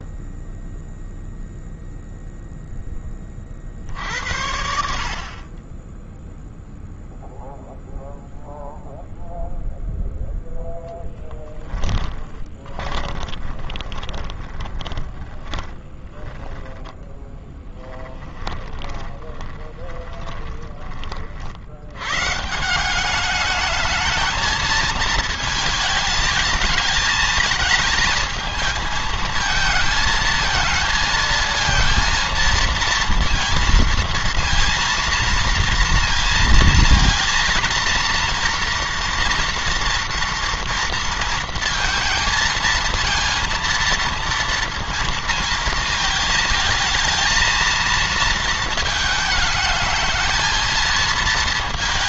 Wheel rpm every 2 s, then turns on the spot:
0, 20, 60, 0, 0, 0, 20, 20, 10, 20, 40, 200, 220, 220, 220, 230, 230, 230, 230, 240, 230, 230, 230, 220, 220, 220.
12-20